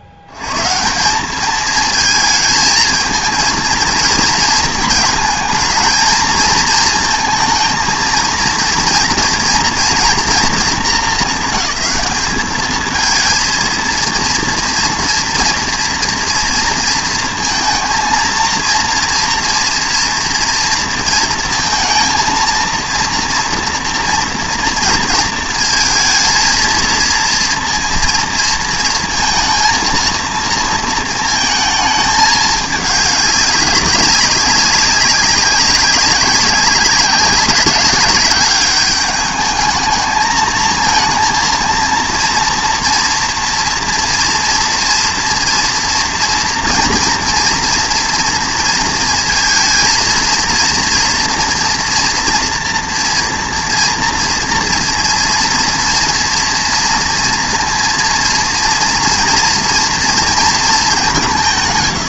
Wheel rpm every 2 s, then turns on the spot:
60, 220, 220, 220, 230, 220, 210, 230, 230, 230, 230, 230, 230, 230, 230, 230, 210, 190, 190, 190, 220, 240, 240, 240, 230, 230, 230, 230, 230, 240, 210.
none